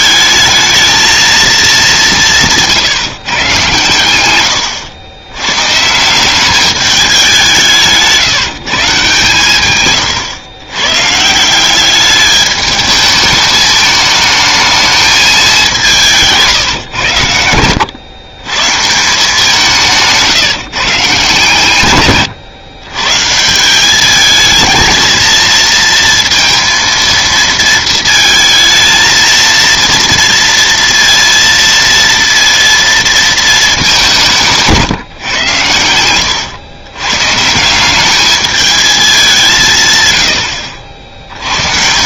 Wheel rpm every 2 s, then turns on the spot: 220, 160, 100, 200, 160, 120, 210, 220, 140, 140, 140, 120, 220, 230, 220, 230, 230, 170, 110, 210, 70.
none